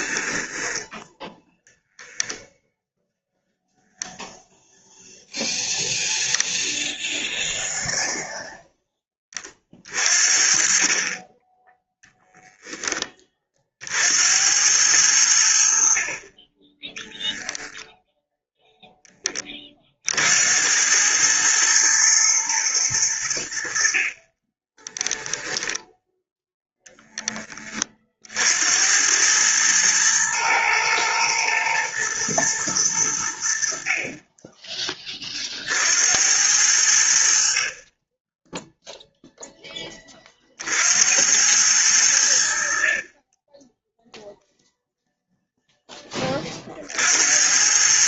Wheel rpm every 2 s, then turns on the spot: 10, 0, 0, 0, 10, 30, 10, 90, 10, 0, 90, 110, 20, 0, 90, 120, 100, 20, 80, 0, 60, 50, 0, 40.
0-2 24-26